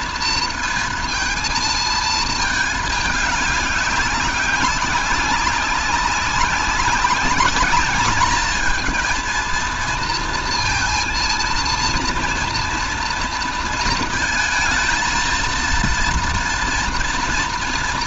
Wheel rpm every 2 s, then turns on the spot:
230, 220, 200, 200, 220, 230, 230, 230, 240.
none